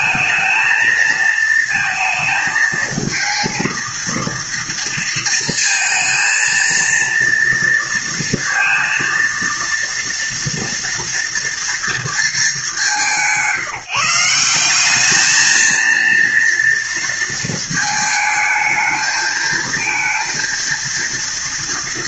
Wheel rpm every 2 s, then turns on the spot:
220, 220, 230, 230, 230, 230, 180, 180, 230, 220, 230.
none